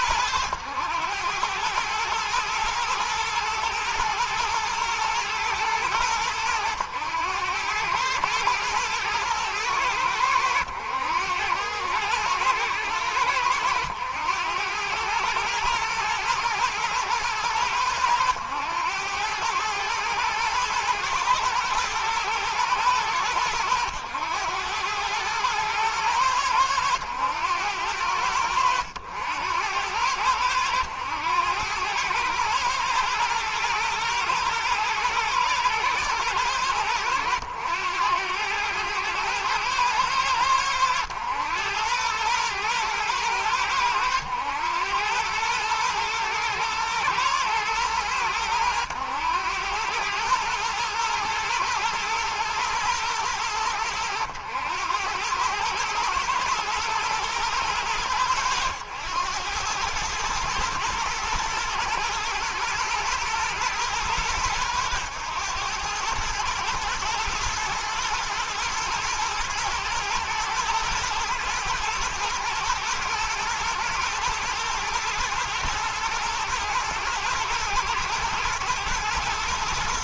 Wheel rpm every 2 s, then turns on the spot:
100, 110, 120, 100, 110, 80, 100, 110, 110, 100, 110, 110, 110, 100, 90, 100, 120, 110, 100, 110, 100, 110, 100, 110, 90, 120, 110, 100, 110, 100, 110, 120, 110, 110, 110, 120, 120, 110, 110, 110.
none